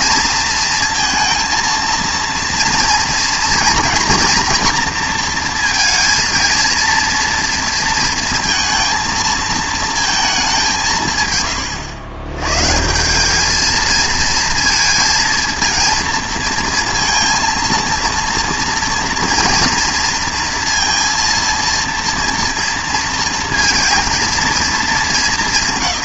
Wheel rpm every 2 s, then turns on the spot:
230, 230, 230, 230, 230, 190, 140, 230, 230, 230, 230, 230, 230.
none